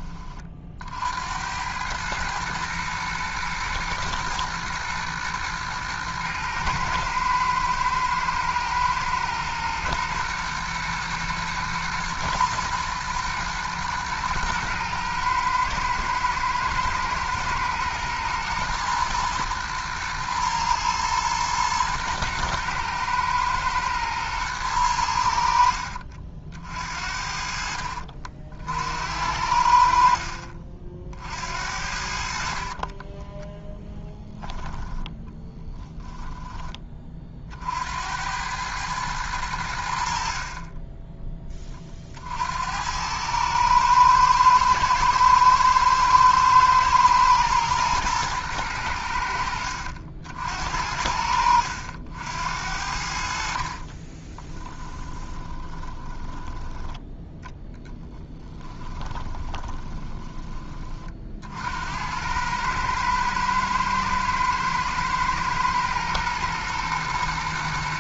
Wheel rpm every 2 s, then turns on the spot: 50, 110, 110, 110, 110, 110, 110, 110, 110, 120, 110, 110, 100, 60, 60, 40, 20, 10, 20, 110, 20, 90, 110, 110, 100, 70, 70, 10, 10, 20, 30, 110, 110, 120.
34-36 54-56 58-60